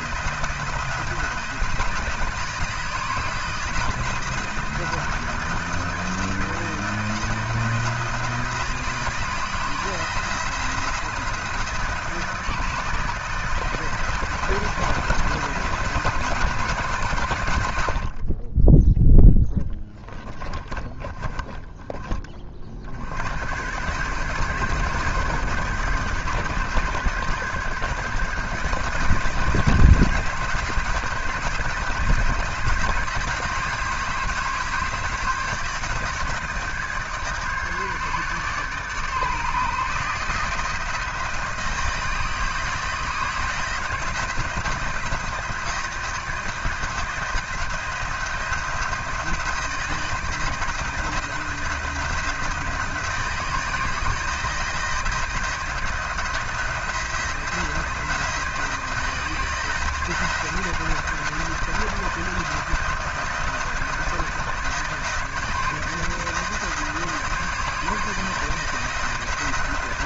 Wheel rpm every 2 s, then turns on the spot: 170, 160, 160, 160, 160, 170, 150, 170, 160, 10, 30, 50, 150, 140, 150, 170, 160, 160, 150, 150, 160, 160, 170, 160, 170, 160, 160, 160, 170, 170, 170, 160, 160, 160, 160.
20-22